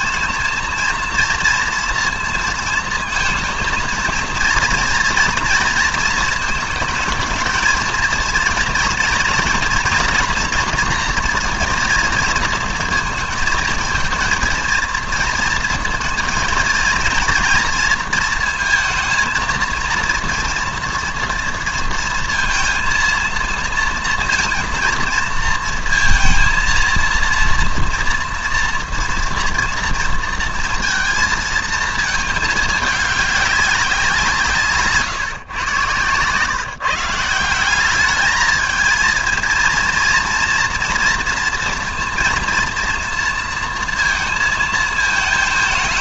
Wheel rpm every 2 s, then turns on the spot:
230, 230, 230, 220, 230, 240, 230, 230, 230, 230, 230, 230, 230, 230, 240, 230, 210, 160, 140, 220, 240, 230, 220.
none